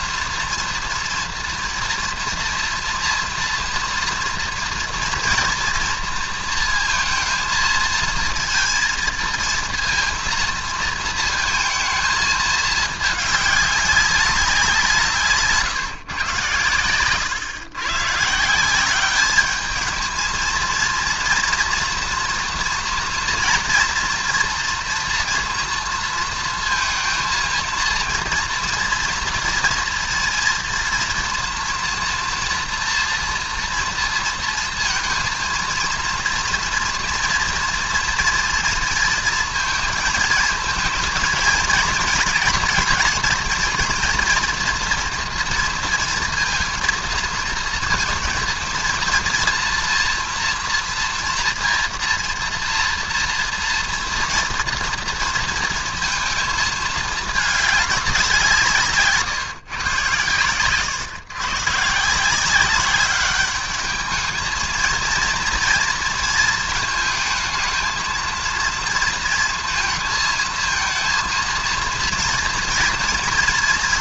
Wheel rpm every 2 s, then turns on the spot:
230, 230, 230, 230, 220, 230, 220, 190, 120, 140, 220, 230, 230, 230, 230, 230, 230, 230, 230, 230, 220, 230, 230, 230, 230, 230, 230, 240, 230, 190, 120, 160, 210, 230, 220, 230, 230.
none